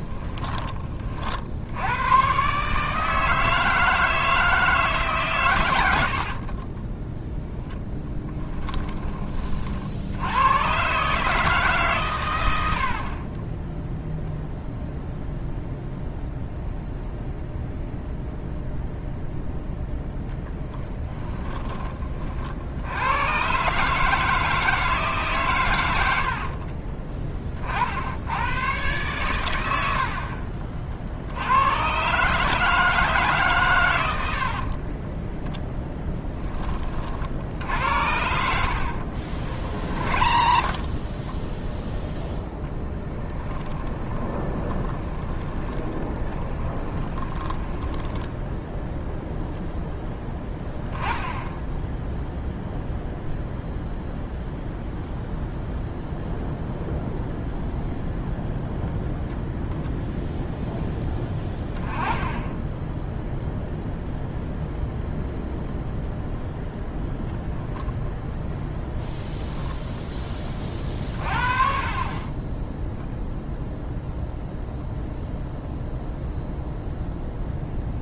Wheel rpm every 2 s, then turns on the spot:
30, 150, 160, 20, 30, 130, 60, 0, 0, 0, 10, 80, 150, 30, 110, 50, 150, 40, 30, 70, 40, 10, 20, 20, 0, 10, 0, 0, 0, 0, 10, 10, 0, 0, 10, 40, 10, 0, 0.
6-10 20-22 26-28 34-36 38-48